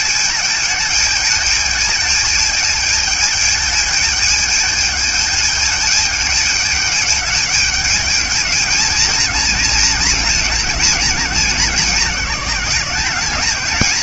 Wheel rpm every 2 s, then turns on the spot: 220, 220, 210, 210, 220, 220, 200.
none